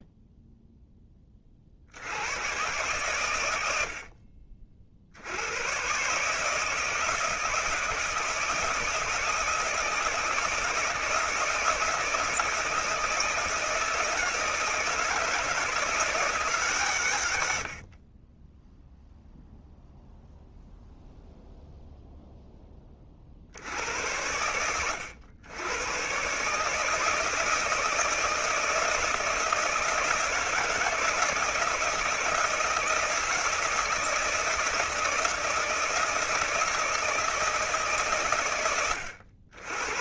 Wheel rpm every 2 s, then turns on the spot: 20, 110, 70, 160, 160, 160, 160, 160, 120, 0, 0, 50, 90, 160, 160, 160, 160, 160, 160, 100.
none